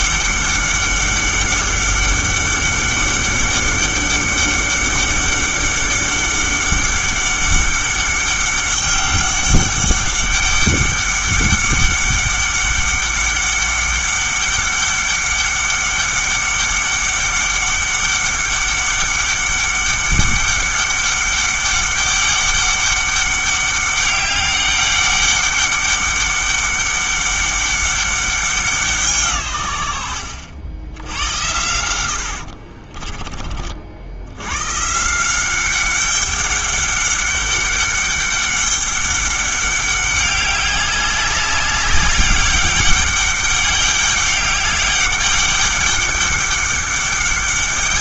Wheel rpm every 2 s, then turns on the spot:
200, 200, 200, 200, 200, 200, 200, 200, 200, 200, 200, 200, 200, 200, 170, 80, 40, 130, 200, 200, 200, 200, 200, 200.
30-34